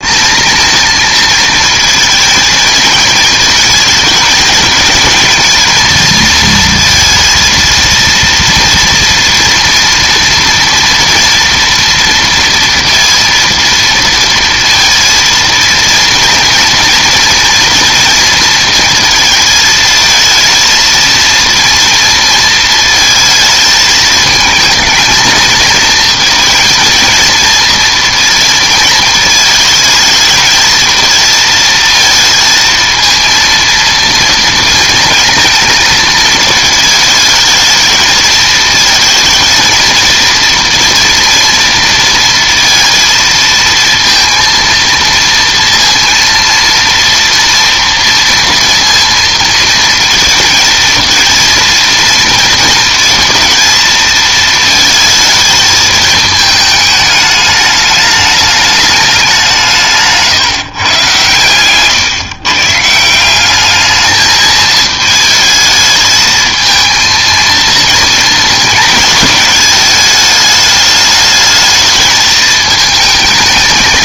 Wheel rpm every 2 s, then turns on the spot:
230, 220, 220, 230, 230, 230, 230, 230, 230, 230, 230, 230, 220, 230, 230, 220, 230, 230, 220, 220, 230, 230, 230, 230, 230, 230, 230, 220, 210, 210, 140, 150, 220, 220, 230, 210, 220.
none